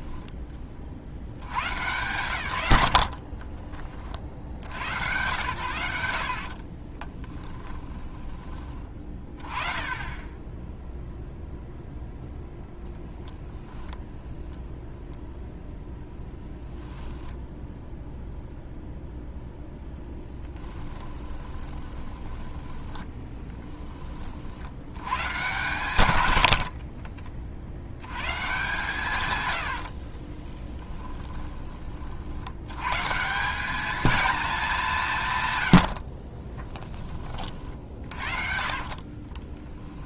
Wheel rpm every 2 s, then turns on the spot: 40, 90, 90, 30, 20, 0, 0, 0, 0, 0, 10, 10, 90, 40, 150, 10, 110, 180, 20, 40.
6-8 20-24 26-28 30-32 38-40